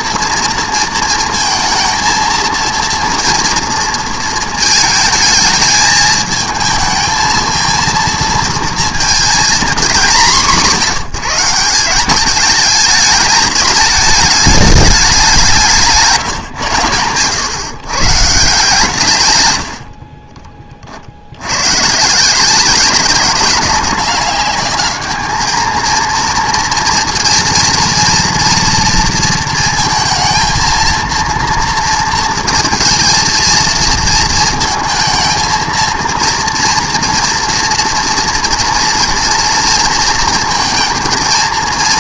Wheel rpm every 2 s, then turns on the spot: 230, 230, 220, 220, 230, 200, 210, 210, 130, 140, 30, 180, 200, 230, 230, 230, 230, 230, 230, 240, 230.
none